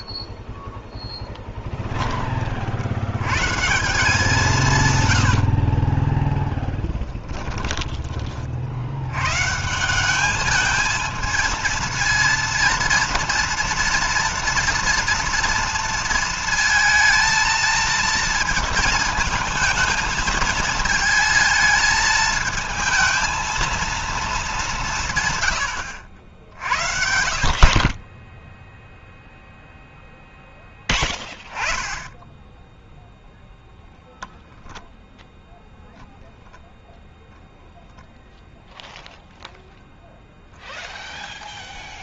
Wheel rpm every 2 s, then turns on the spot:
10, 60, 160, 10, 60, 220, 230, 230, 220, 220, 220, 220, 190, 60, 0, 10, 10, 0, 0, 0, 0.
0-2